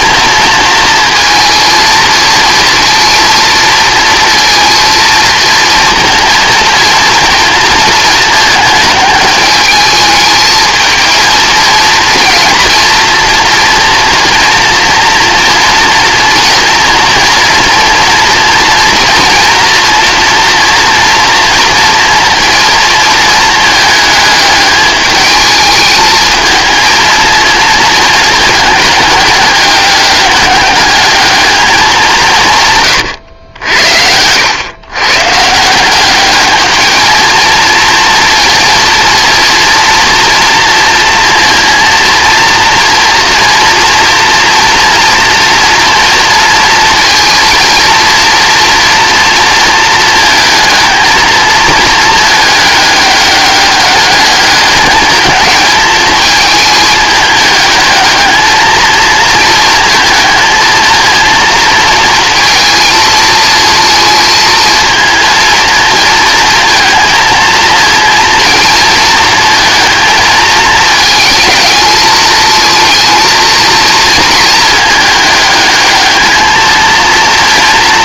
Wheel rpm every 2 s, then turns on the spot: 230, 230, 230, 230, 220, 220, 230, 230, 230, 230, 230, 230, 220, 230, 210, 200, 140, 120, 220, 230, 230, 230, 240, 230, 230, 220, 210, 200, 210, 220, 230, 220, 220, 230, 230, 220, 220, 220, 220.
none